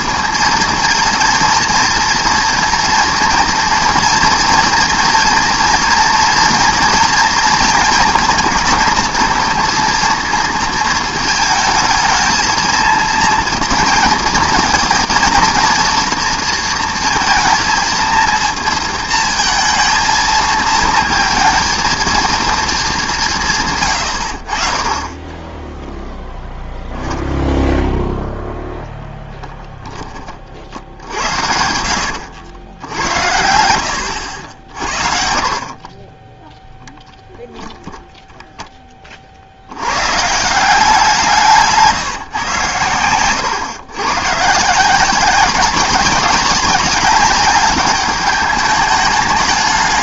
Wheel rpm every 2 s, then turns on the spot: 230, 230, 230, 230, 230, 230, 230, 230, 240, 230, 220, 230, 40, 0, 10, 50, 80, 60, 0, 10, 170, 120, 160, 200, 210.
none